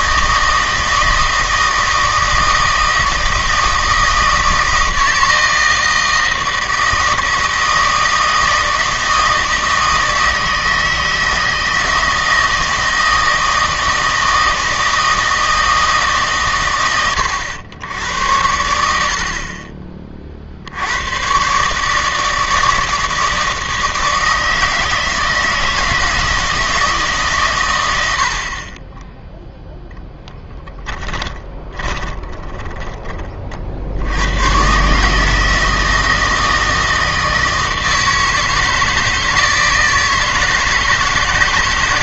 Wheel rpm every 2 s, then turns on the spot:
160, 160, 160, 160, 160, 160, 160, 160, 120, 90, 80, 160, 160, 160, 40, 10, 20, 130, 160, 160, 160.
30-34